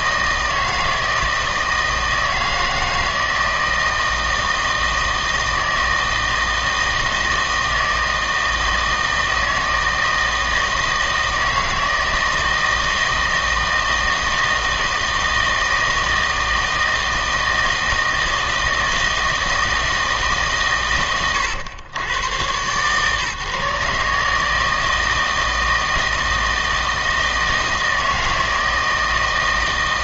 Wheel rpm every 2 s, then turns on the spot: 160, 160, 160, 160, 160, 160, 160, 160, 160, 160, 130, 130, 160, 160, 160.
none